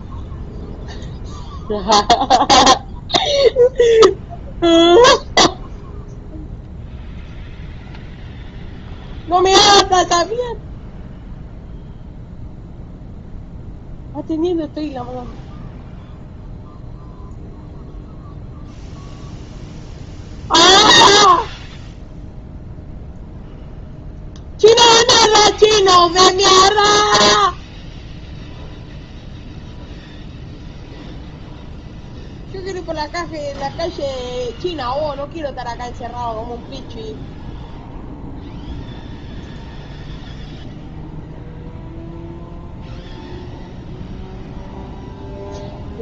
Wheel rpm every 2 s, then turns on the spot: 0, 0, 0, 0, 0, 0, 0, 0, 0, 0, 0, 0, 0, 0, 0, 0, 0, 0, 0, 0, 0, 0, 0.
none